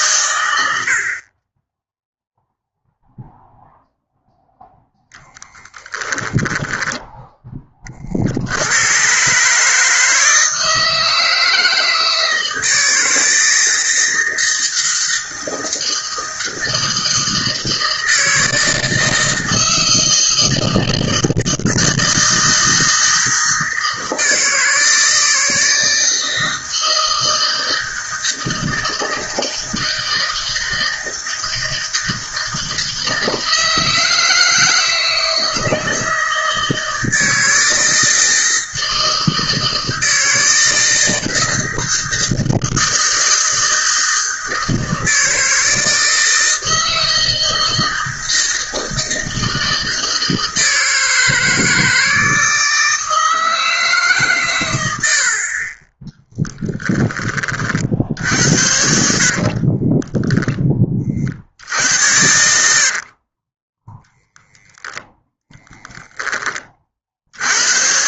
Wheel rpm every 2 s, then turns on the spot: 60, 0, 0, 0, 110, 160, 160, 160, 160, 160, 160, 160, 160, 160, 160, 160, 160, 160, 160, 160, 160, 160, 160, 160, 160, 160, 160, 80, 10, 60, 30, 60, 0, 40.
54-60 62-64